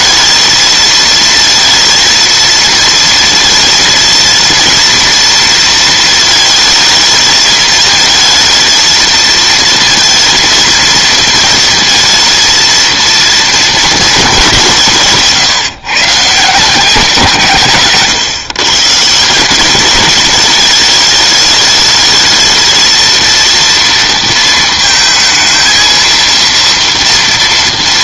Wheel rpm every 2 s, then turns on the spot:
230, 230, 230, 220, 220, 230, 230, 160, 180, 140, 210, 220, 230, 230.
none